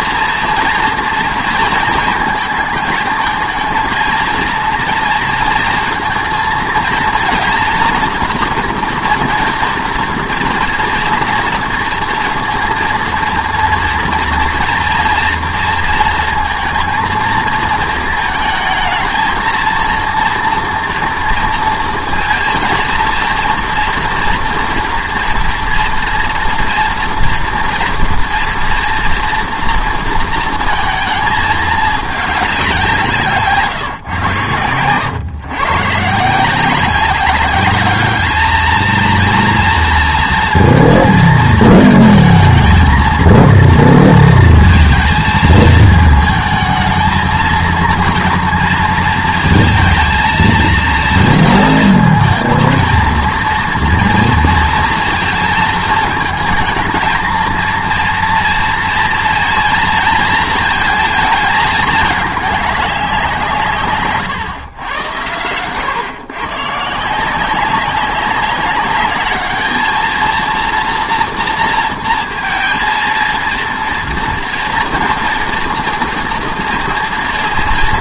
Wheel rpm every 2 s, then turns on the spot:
240, 220, 230, 230, 230, 230, 230, 240, 230, 220, 240, 230, 230, 240, 230, 230, 180, 110, 180, 220, 230, 230, 230, 220, 230, 230, 230, 230, 220, 230, 220, 200, 120, 150, 200, 230, 230, 230, 230.
none